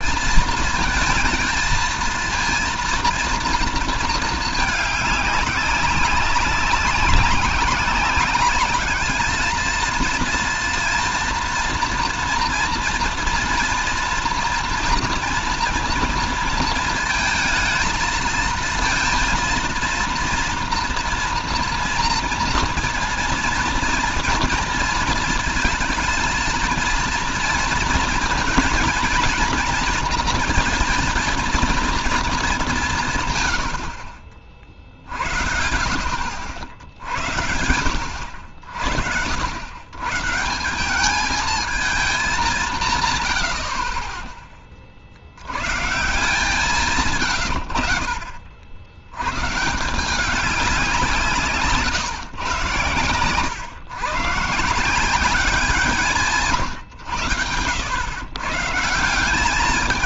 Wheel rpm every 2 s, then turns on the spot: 230, 230, 210, 200, 210, 230, 240, 240, 230, 230, 230, 230, 230, 230, 230, 230, 160, 50, 80, 70, 170, 150, 40, 140, 80, 180, 110, 170, 100, 160.
none